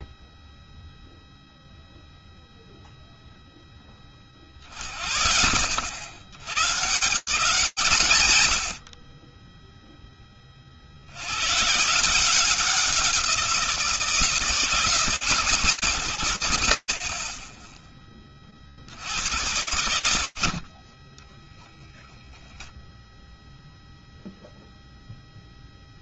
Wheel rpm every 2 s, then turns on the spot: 0, 0, 30, 110, 130, 20, 180, 160, 90, 30, 70, 0, 0.
none